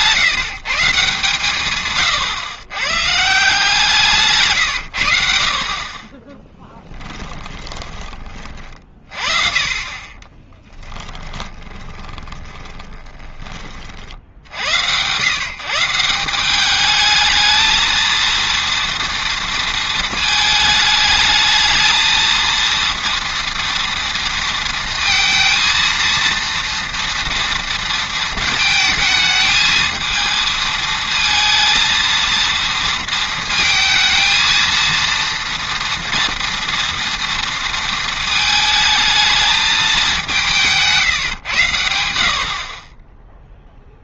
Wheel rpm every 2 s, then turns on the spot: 150, 120, 120, 10, 40, 20, 20, 90, 200, 230, 220, 230, 230, 230, 220, 220, 230, 230, 230, 220, 150, 40.
6-8 10-14 40-42